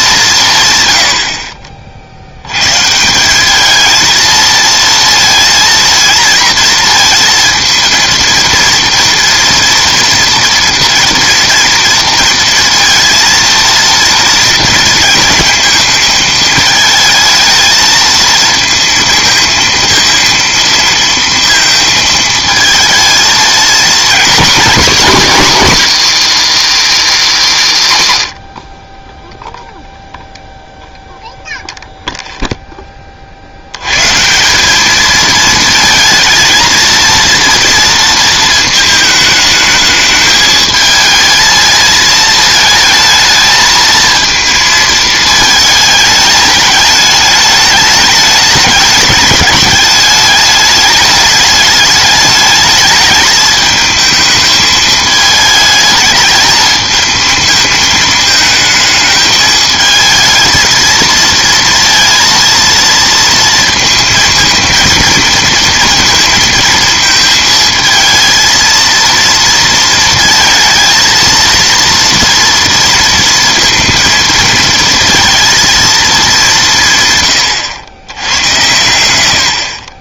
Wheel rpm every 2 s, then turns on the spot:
150, 110, 230, 230, 230, 230, 230, 230, 220, 220, 230, 220, 240, 180, 30, 0, 0, 180, 230, 220, 220, 220, 220, 210, 210, 210, 210, 220, 220, 220, 230, 230, 230, 230, 230, 230, 230, 230, 180, 110.
none